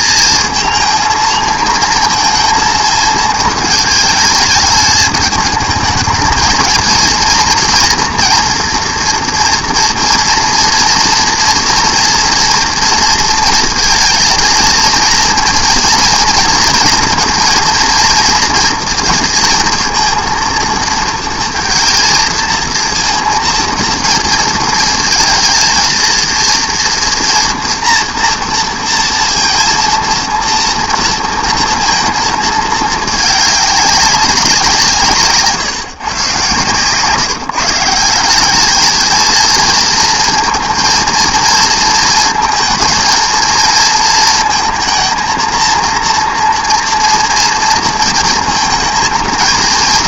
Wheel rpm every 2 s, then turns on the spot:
230, 220, 220, 220, 240, 230, 230, 230, 230, 230, 230, 230, 230, 230, 230, 230, 220, 170, 120, 200, 230, 230, 230, 230, 230.
none